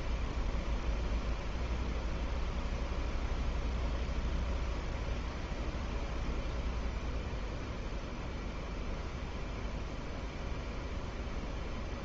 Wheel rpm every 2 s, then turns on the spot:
0, 0, 0, 0, 0, 0.
none